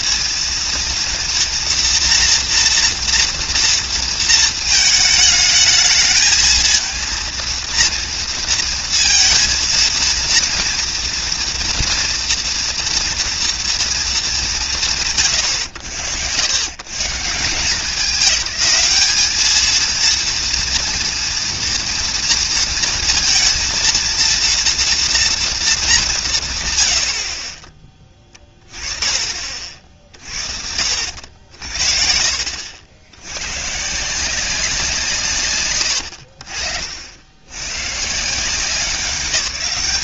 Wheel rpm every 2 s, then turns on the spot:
230, 230, 220, 230, 230, 230, 230, 150, 100, 200, 240, 230, 230, 100, 20, 70, 80, 170, 60, 190.
none